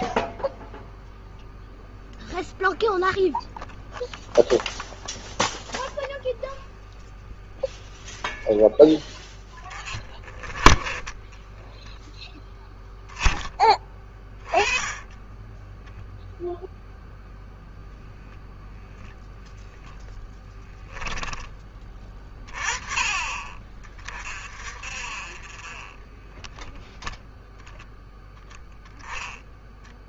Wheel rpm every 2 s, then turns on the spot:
0, 0, 0, 0, 10, 20, 10, 20, 0, 0, 10, 30, 40, 0, 10.
none